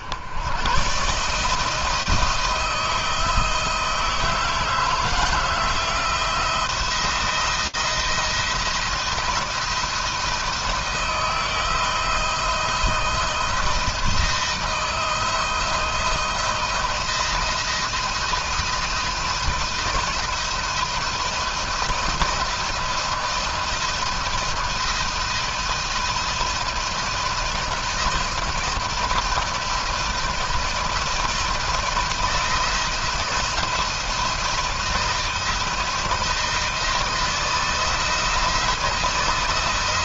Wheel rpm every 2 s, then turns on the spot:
140, 160, 160, 170, 170, 160, 160, 170, 170, 160, 160, 170, 160, 160, 160, 160, 160, 170, 160, 170.
none